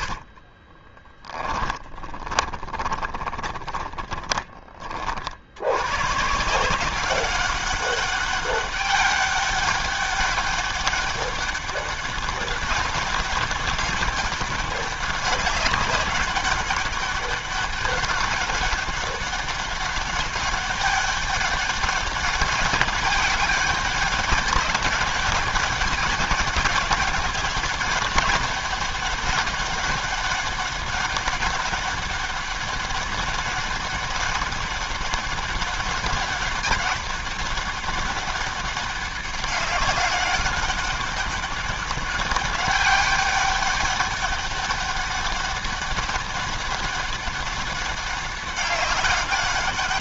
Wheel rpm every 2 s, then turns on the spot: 40, 30, 40, 170, 200, 200, 200, 200, 200, 200, 200, 200, 200, 200, 200, 190, 200, 200, 200, 200, 200, 200, 200, 200, 200.
0-4